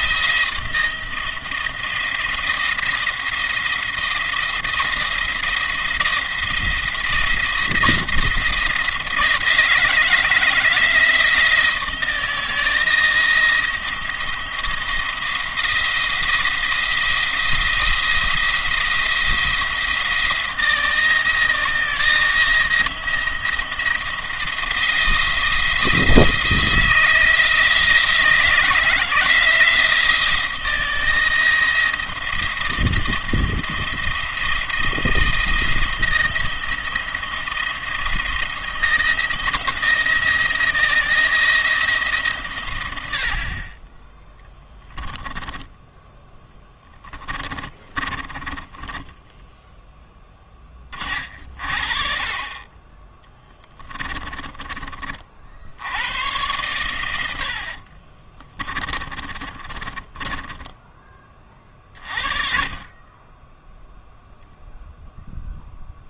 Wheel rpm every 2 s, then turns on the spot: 170, 170, 170, 170, 170, 170, 170, 170, 170, 170, 170, 170, 160, 160, 170, 170, 160, 170, 170, 170, 170, 100, 10, 20, 10, 40, 20, 40, 110, 20, 20, 20, 0.
44-50 58-60